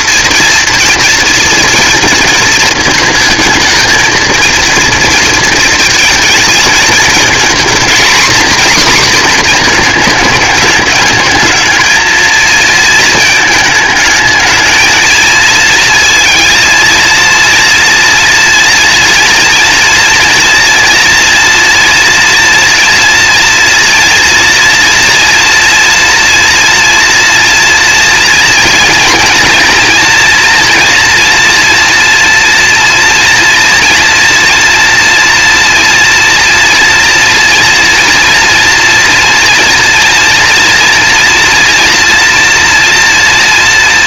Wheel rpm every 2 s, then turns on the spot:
230, 220, 220, 220, 250, 210, 230, 220, 230, 230, 230, 230, 230, 240, 240, 230, 240, 230, 230, 240, 230, 230.
none